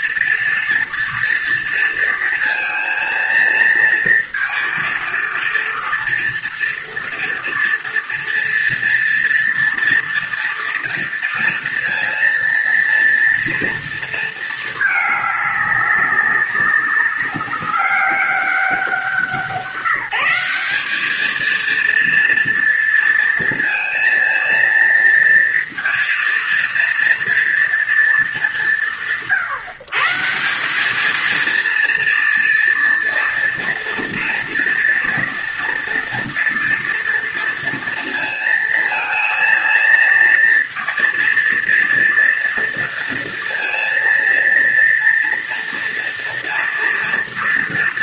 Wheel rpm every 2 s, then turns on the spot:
230, 230, 230, 230, 230, 230, 230, 210, 200, 180, 200, 230, 230, 230, 140, 200, 230, 230, 240, 230, 230, 230, 230, 230.
none